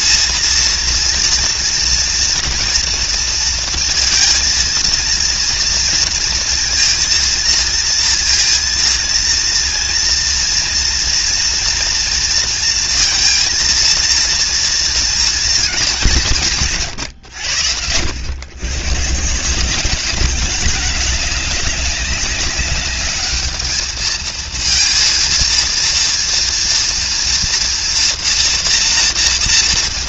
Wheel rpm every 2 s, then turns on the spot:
230, 230, 230, 230, 230, 230, 230, 230, 190, 100, 190, 200, 220, 230, 240.
none